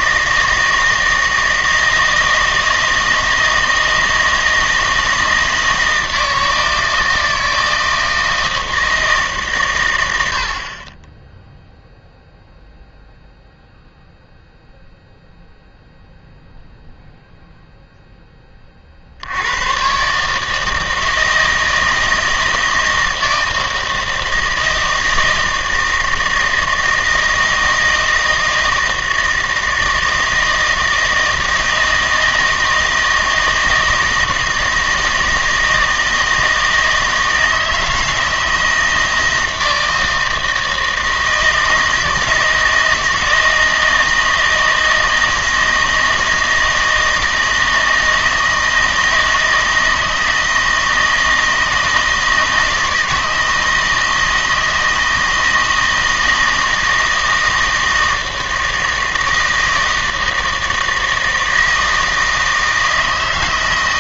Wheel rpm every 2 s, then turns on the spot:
160, 160, 160, 160, 160, 50, 0, 0, 0, 30, 160, 160, 160, 160, 160, 160, 160, 160, 160, 160, 160, 160, 160, 160, 160, 160, 160, 160, 160, 160, 160, 160.
none